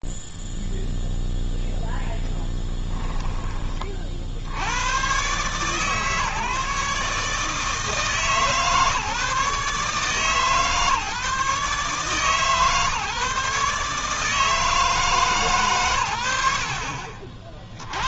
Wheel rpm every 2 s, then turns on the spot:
0, 0, 30, 140, 150, 150, 150, 150, 100.
none